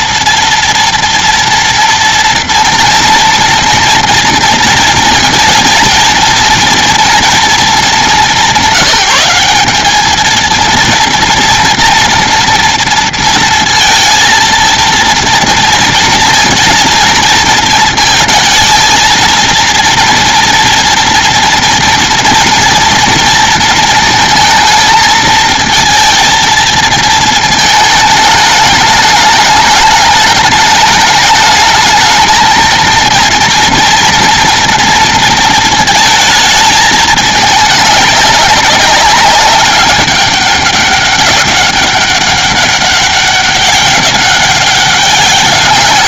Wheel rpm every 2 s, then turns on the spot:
230, 230, 220, 230, 190, 230, 230, 230, 230, 220, 230, 230, 220, 230, 210, 210, 230, 230, 210, 190, 200, 200, 200.
none